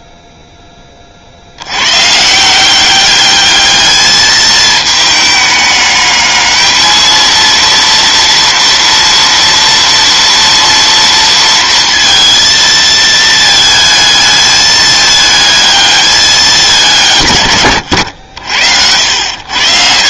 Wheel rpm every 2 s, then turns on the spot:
10, 180, 220, 220, 230, 230, 220, 220, 200, 80.
none